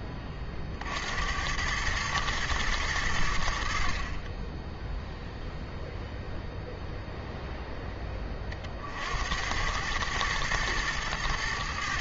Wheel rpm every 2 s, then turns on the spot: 50, 110, 10, 0, 50, 110.
none